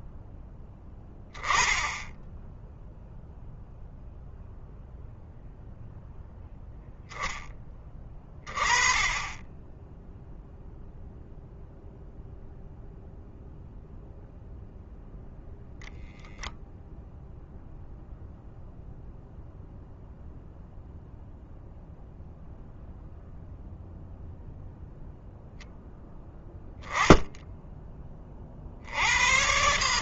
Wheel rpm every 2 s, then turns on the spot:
10, 0, 0, 10, 20, 0, 0, 0, 0, 0, 0, 0, 0, 10, 90.
none